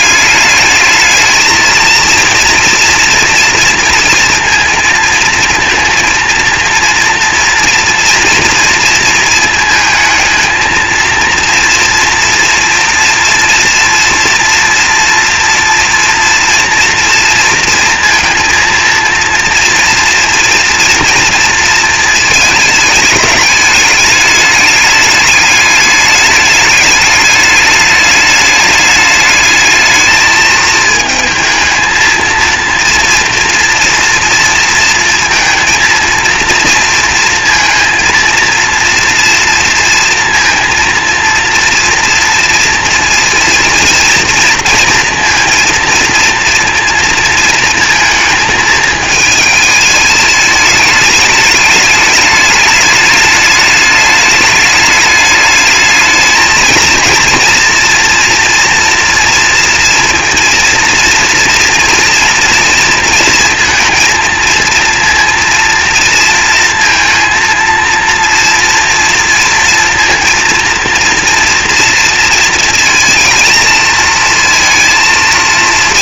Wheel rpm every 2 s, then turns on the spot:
210, 230, 230, 230, 230, 230, 230, 240, 230, 230, 230, 220, 210, 210, 210, 220, 230, 230, 230, 230, 230, 230, 230, 230, 220, 210, 210, 210, 220, 230, 230, 230, 230, 230, 230, 230, 230, 230.
none